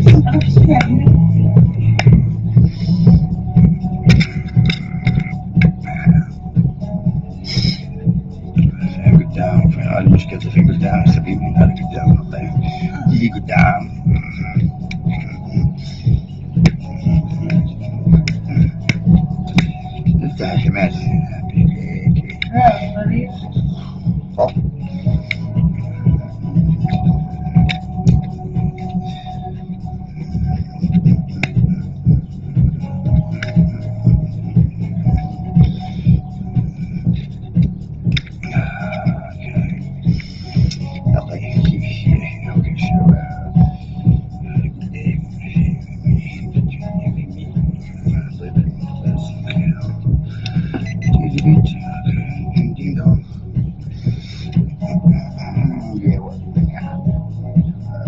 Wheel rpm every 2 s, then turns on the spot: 0, 0, 0, 0, 0, 0, 0, 0, 0, 0, 0, 0, 0, 0, 0, 0, 0, 0, 0, 0, 0, 0, 0, 0, 0, 0, 0, 0, 0.
none